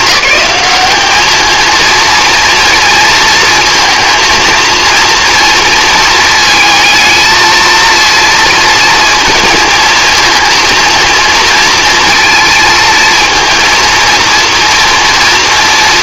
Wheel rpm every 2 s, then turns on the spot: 210, 230, 230, 220, 230, 230, 230, 230.
none